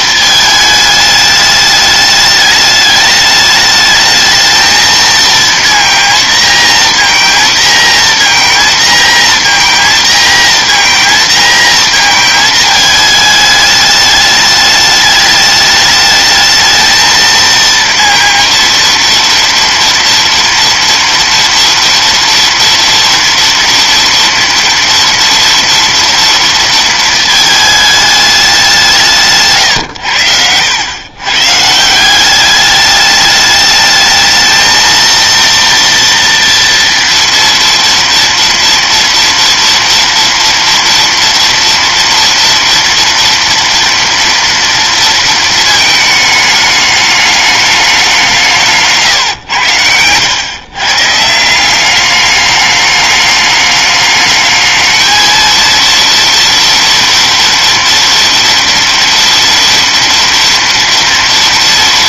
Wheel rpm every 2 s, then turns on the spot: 220, 210, 220, 230, 230, 230, 220, 210, 220, 230, 230, 230, 240, 230, 190, 100, 200, 220, 230, 230, 230, 230, 230, 210, 160, 120, 210, 220, 240, 230, 230.
none